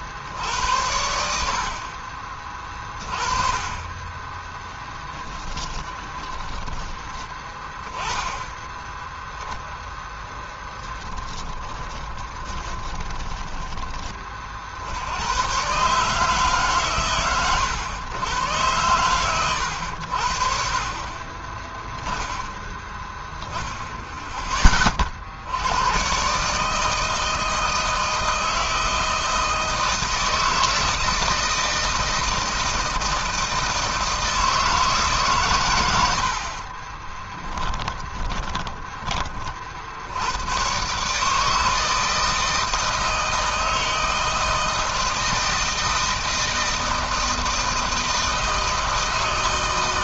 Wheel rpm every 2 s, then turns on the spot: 80, 30, 10, 20, 10, 20, 20, 100, 120, 100, 20, 10, 60, 160, 160, 160, 160, 130, 20, 40, 150, 160, 160, 160, 160.
4-6 10-12 36-38